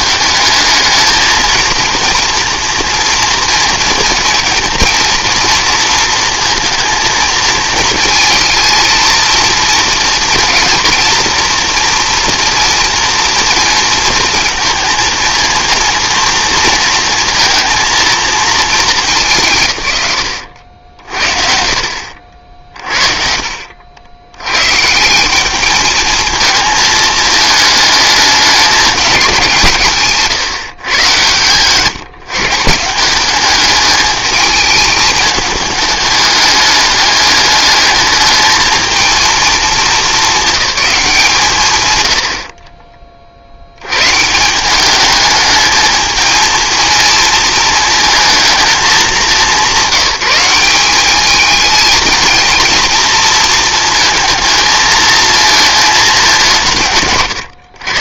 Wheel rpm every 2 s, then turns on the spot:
220, 230, 230, 230, 230, 230, 240, 230, 230, 220, 80, 50, 140, 220, 200, 130, 160, 220, 210, 220, 200, 30, 190, 230, 210, 190, 230, 220, 170.
42-44